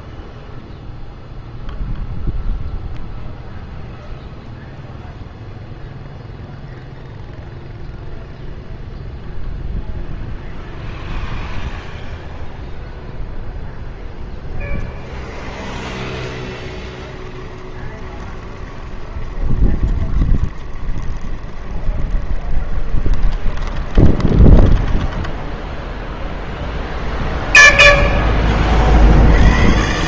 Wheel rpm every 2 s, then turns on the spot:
0, 0, 0, 0, 0, 0, 0, 10, 10, 20, 20, 20, 10, 10, 20.
16-28